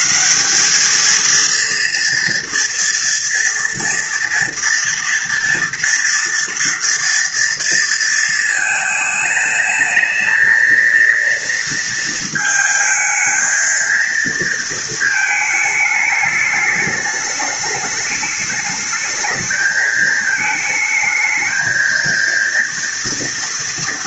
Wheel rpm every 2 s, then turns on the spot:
210, 230, 230, 230, 220, 230, 220, 220, 210, 210, 220, 230.
none